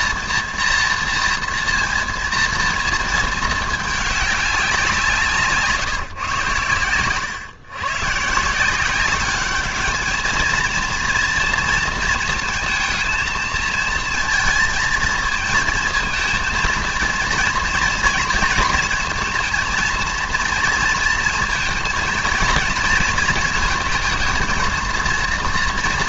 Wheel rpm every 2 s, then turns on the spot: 230, 230, 190, 110, 170, 230, 230, 230, 230, 230, 230, 230, 230.
none